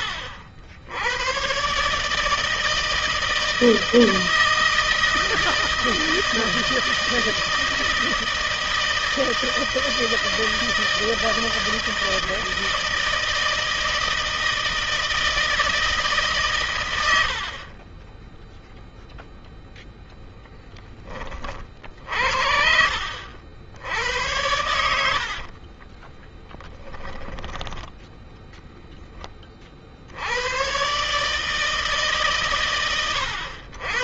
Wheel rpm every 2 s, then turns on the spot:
80, 160, 160, 160, 160, 160, 160, 160, 90, 0, 20, 60, 70, 10, 0, 100, 110.
16-18 24-26